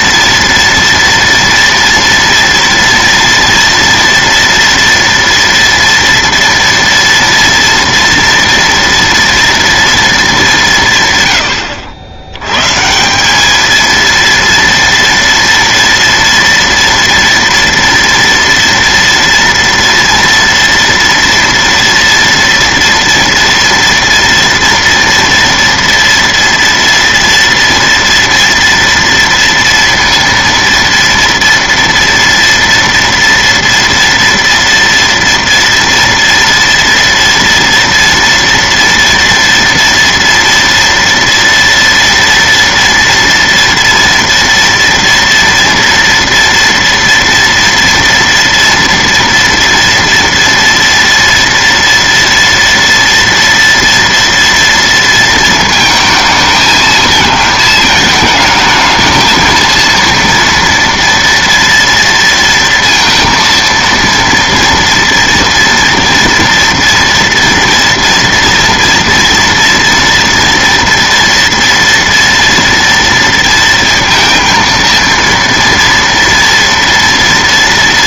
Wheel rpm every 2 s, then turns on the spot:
230, 230, 240, 230, 230, 120, 170, 230, 230, 230, 230, 230, 230, 230, 230, 230, 230, 230, 230, 230, 230, 230, 230, 230, 230, 230, 230, 230, 220, 220, 230, 230, 240, 230, 230, 230, 230, 230, 230.
none